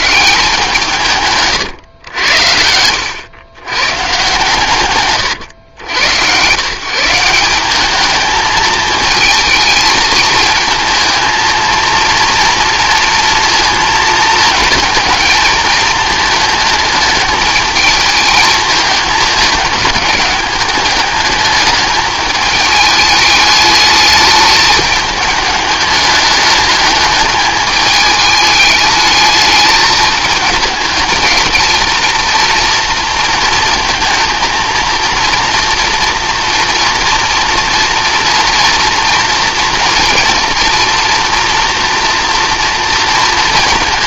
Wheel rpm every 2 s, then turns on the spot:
170, 90, 130, 140, 220, 220, 230, 220, 220, 210, 210, 210, 210, 210, 210, 210, 230, 230, 230, 230, 240, 230.
none